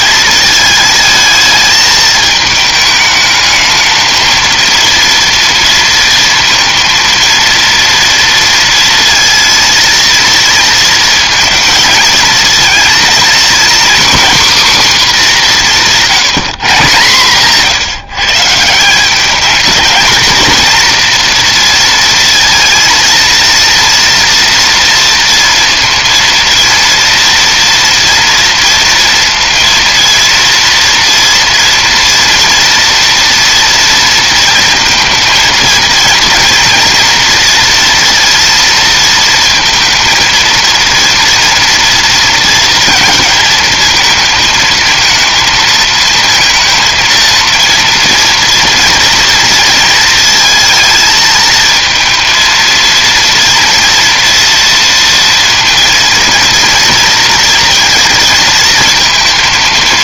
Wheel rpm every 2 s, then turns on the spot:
220, 220, 230, 230, 230, 230, 230, 270, 160, 170, 240, 230, 230, 230, 230, 230, 230, 230, 230, 230, 230, 230, 230, 230, 230, 230, 230, 230, 230, 230.
none